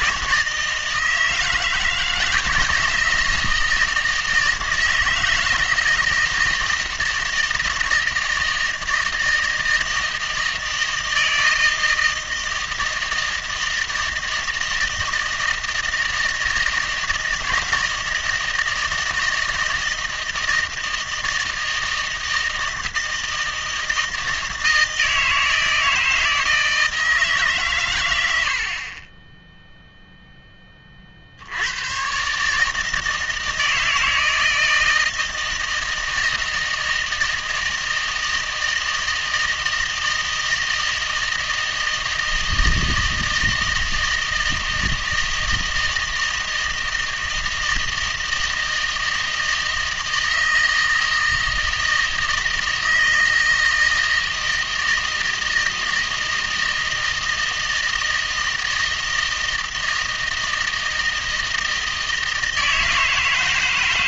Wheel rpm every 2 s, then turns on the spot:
160, 160, 160, 160, 160, 160, 160, 160, 160, 160, 160, 160, 160, 160, 40, 40, 160, 160, 160, 160, 160, 160, 160, 160, 160, 160, 160, 160, 160, 160, 160, 160.
none